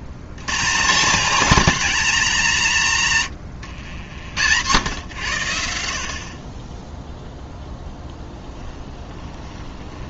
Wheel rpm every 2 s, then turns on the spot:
90, 190, 90, 20, 10.
8-10